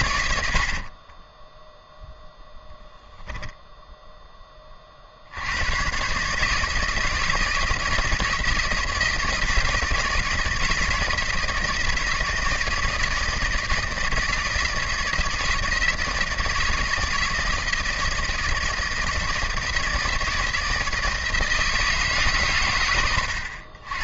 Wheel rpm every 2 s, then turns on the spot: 60, 10, 30, 150, 160, 160, 160, 160, 160, 160, 160, 120.
0-2